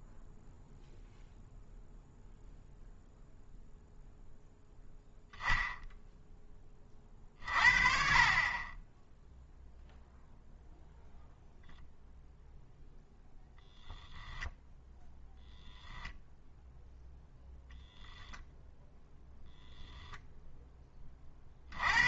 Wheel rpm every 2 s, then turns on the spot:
0, 0, 0, 10, 20, 0, 0, 10, 0, 0, 10.
none